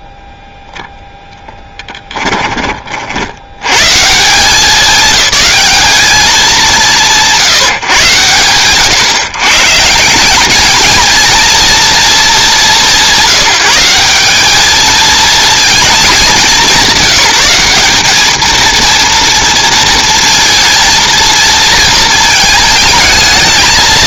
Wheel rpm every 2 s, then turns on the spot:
0, 10, 180, 190, 90, 190, 220, 190, 190, 220, 230, 220.
2-4